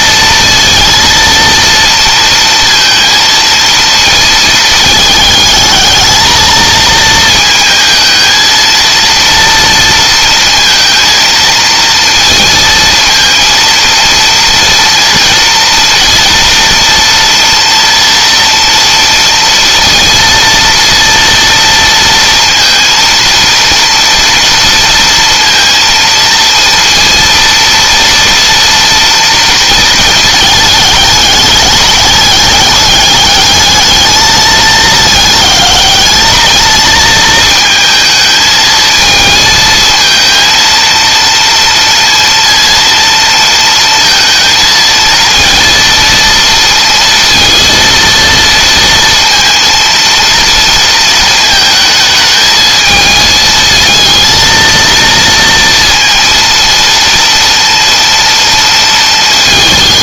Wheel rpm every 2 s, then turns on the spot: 230, 230, 220, 220, 230, 230, 230, 230, 240, 230, 230, 230, 230, 230, 230, 210, 210, 210, 220, 220, 230, 230, 230, 230, 230, 230, 220, 230, 230, 230.
none